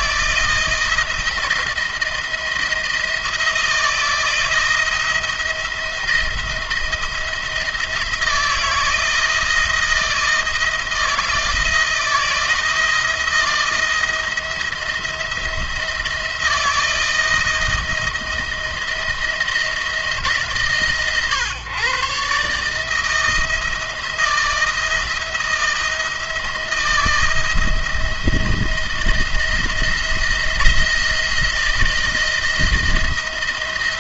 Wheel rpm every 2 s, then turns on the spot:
160, 170, 170, 170, 170, 160, 170, 160, 160, 170, 150, 150, 170, 170, 160, 170, 170.
none